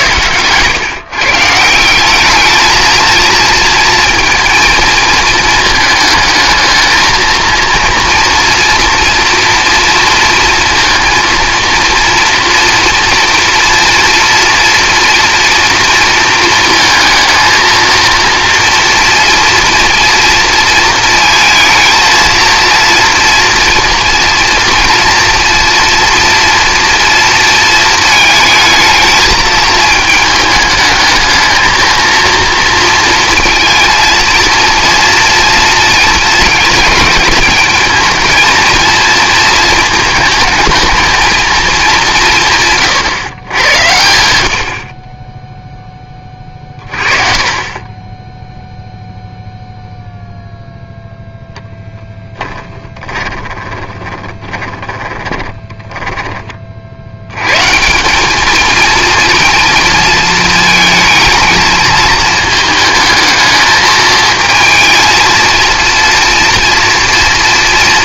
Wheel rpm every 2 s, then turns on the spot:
130, 220, 220, 220, 230, 230, 230, 230, 230, 240, 230, 230, 230, 230, 220, 220, 230, 230, 230, 230, 220, 140, 50, 30, 0, 0, 20, 20, 50, 220, 220, 220, 220, 230.
52-56